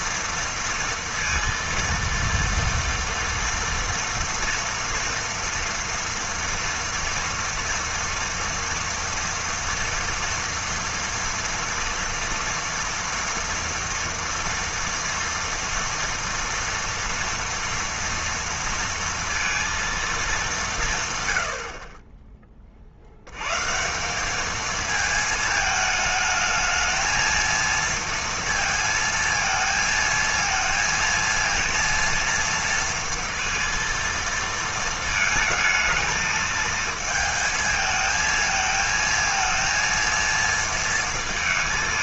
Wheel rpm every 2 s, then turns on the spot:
230, 230, 230, 230, 240, 240, 230, 230, 230, 230, 160, 30, 220, 220, 230, 230, 230, 220, 220, 220, 230.
none